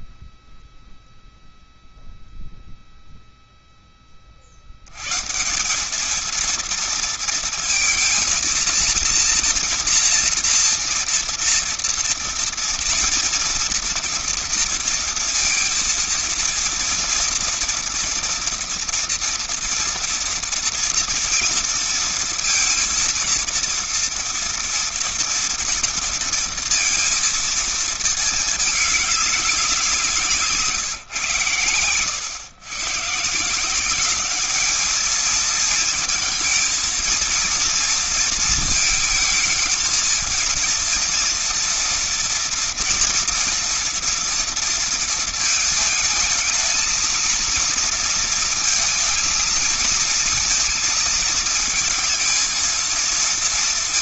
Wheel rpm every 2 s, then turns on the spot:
0, 0, 50, 220, 230, 230, 230, 230, 230, 240, 230, 230, 230, 230, 220, 170, 130, 210, 230, 230, 230, 230, 230, 220, 230, 220, 220.
none